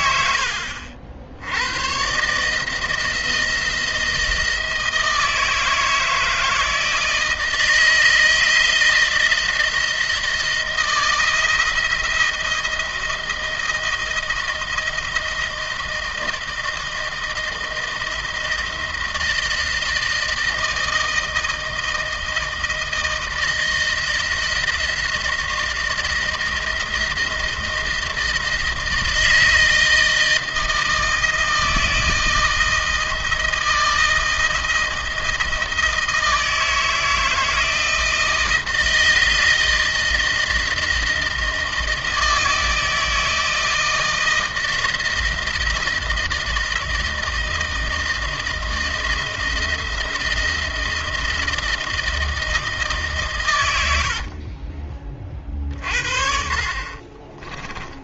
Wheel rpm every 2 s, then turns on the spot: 70, 160, 160, 160, 160, 160, 170, 170, 160, 160, 160, 160, 160, 170, 160, 160, 160, 160, 160, 160, 160, 160, 160, 160, 160, 170, 140, 30, 30.
56-58